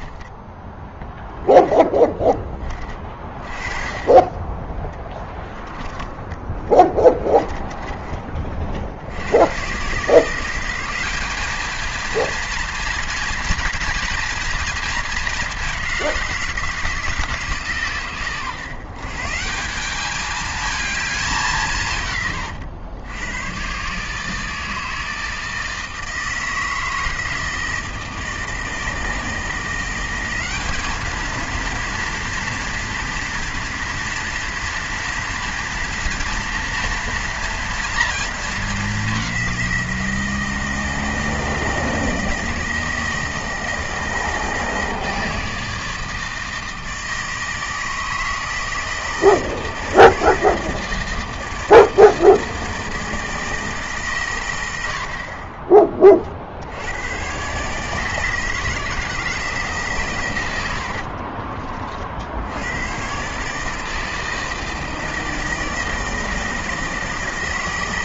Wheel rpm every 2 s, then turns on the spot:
10, 20, 10, 20, 50, 180, 230, 230, 170, 130, 220, 110, 160, 160, 160, 200, 230, 230, 230, 210, 160, 160, 160, 160, 160, 160, 160, 90, 60, 160, 90, 90, 160, 160.
6-8